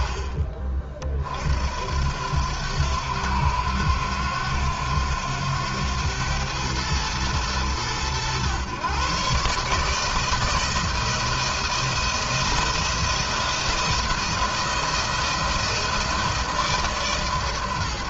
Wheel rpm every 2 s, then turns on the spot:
40, 90, 90, 110, 130, 160, 170, 160, 150.
none